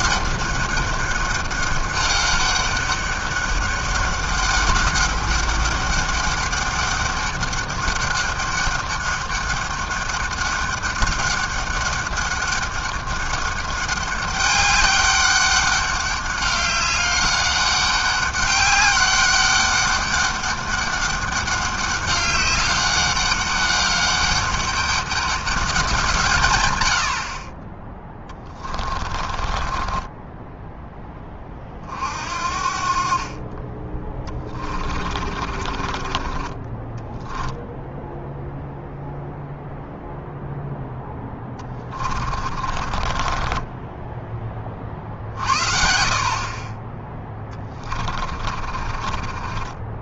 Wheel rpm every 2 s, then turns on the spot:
200, 200, 200, 200, 200, 200, 200, 200, 200, 200, 200, 200, 200, 110, 20, 10, 60, 20, 20, 0, 0, 40, 20, 30, 40.
28-32 34-38 42-44 48-50